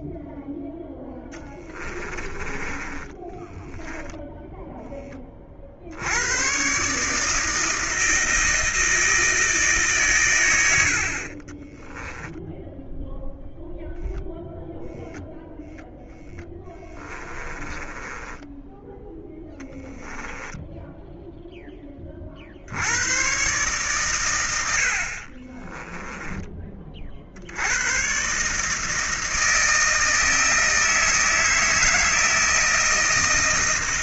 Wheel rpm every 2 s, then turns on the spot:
10, 20, 10, 130, 160, 80, 0, 0, 20, 10, 10, 80, 80, 30, 160, 160, 160.
0-4 16-22